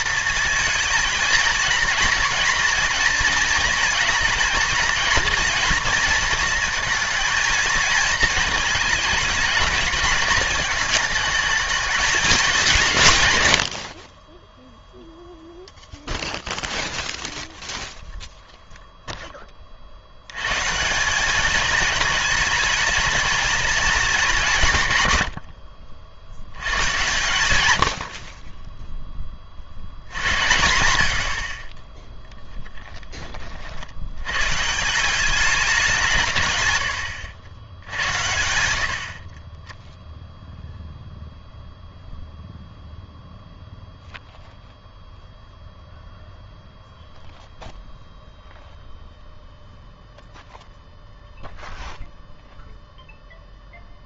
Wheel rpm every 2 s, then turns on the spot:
230, 230, 220, 230, 220, 220, 180, 0, 0, 0, 140, 210, 160, 90, 10, 80, 0, 140, 120, 80, 0, 0, 0, 0, 0, 0, 0.
none